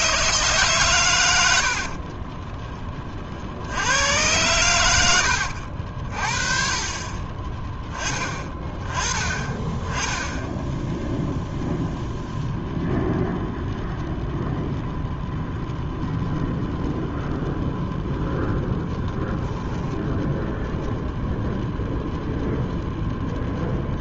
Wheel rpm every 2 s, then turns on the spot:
130, 20, 90, 40, 20, 0, 0, 0, 0, 0, 0, 0.
none